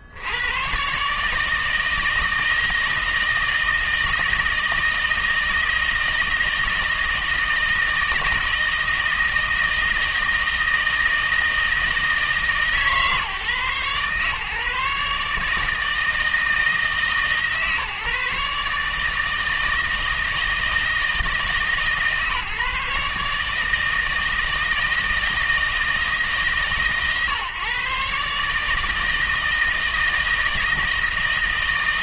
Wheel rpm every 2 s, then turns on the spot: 120, 160, 160, 160, 160, 160, 150, 150, 160, 150, 160, 150, 160, 140, 150, 160.
none